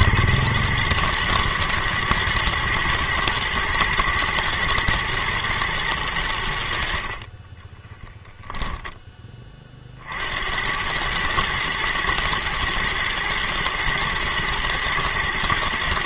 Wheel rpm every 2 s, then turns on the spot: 120, 110, 120, 70, 10, 90, 110, 110.
none